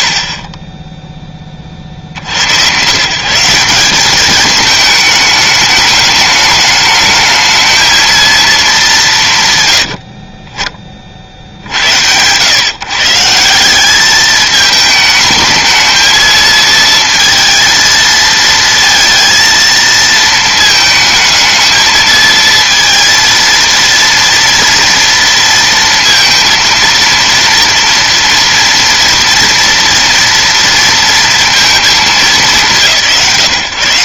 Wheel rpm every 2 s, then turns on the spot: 20, 110, 210, 210, 190, 20, 130, 210, 230, 230, 220, 230, 230, 230, 230, 230, 150.
none